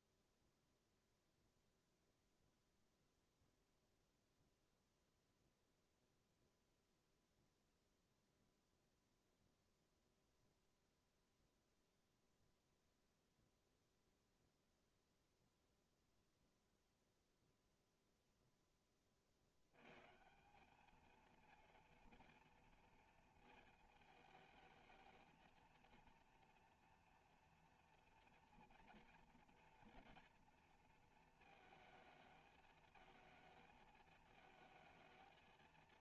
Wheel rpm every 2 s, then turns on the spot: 0, 0, 0, 0, 0, 0, 0, 0, 0, 10, 200, 230, 220, 230, 230, 230, 220, 220.
none